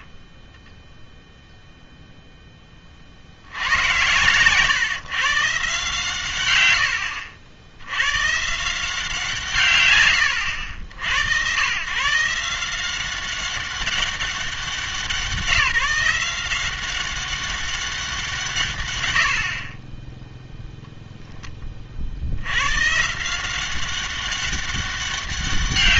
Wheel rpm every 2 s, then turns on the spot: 10, 20, 120, 110, 160, 80, 170, 180, 180, 140, 0, 110, 200.
0-2